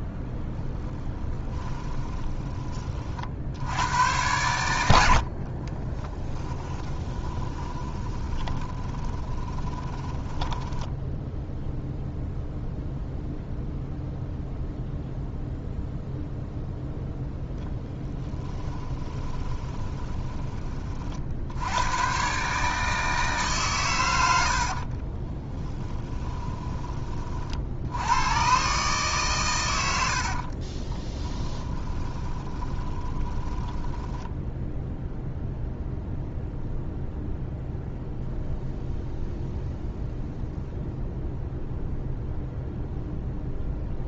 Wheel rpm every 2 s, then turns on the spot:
10, 30, 90, 30, 20, 10, 0, 0, 0, 20, 40, 150, 50, 20, 140, 20, 20, 0, 0, 0, 0, 0.
0-2 6-12 18-20 24-26 30-34